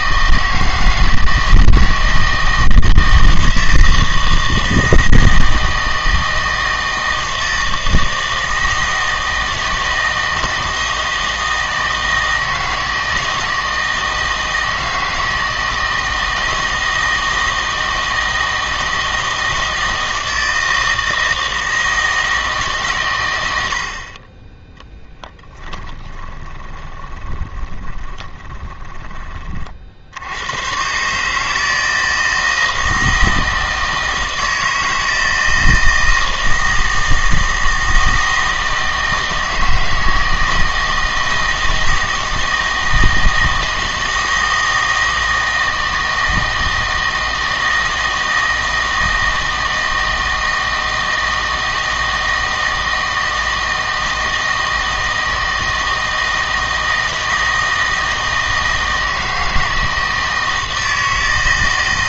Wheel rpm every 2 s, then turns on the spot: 160, 160, 160, 160, 160, 160, 160, 160, 160, 160, 160, 140, 10, 20, 20, 120, 160, 160, 160, 160, 160, 160, 160, 160, 160, 160, 160, 160, 160, 160, 160.
26-30